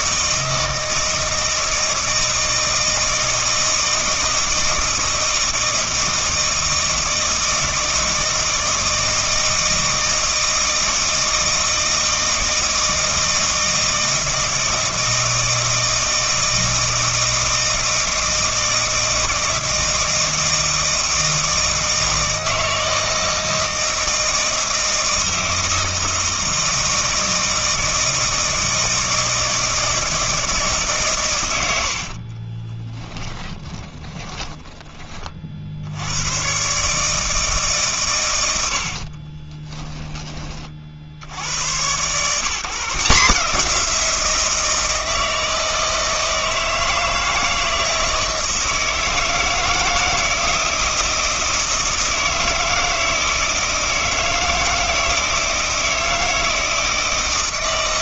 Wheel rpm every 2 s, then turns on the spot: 160, 160, 160, 160, 160, 160, 160, 160, 160, 160, 160, 160, 160, 160, 160, 150, 20, 20, 130, 90, 40, 150, 160, 160, 160, 170, 160, 160, 160.
32-34